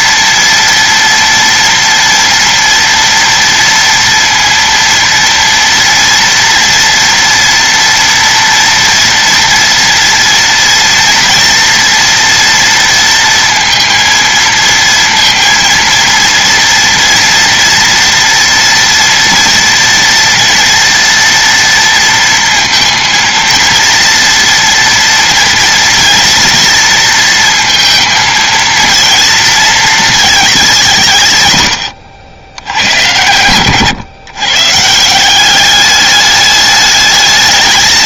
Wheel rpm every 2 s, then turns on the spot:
230, 230, 230, 230, 230, 230, 230, 230, 230, 240, 230, 230, 230, 230, 230, 160, 100, 160, 210.
none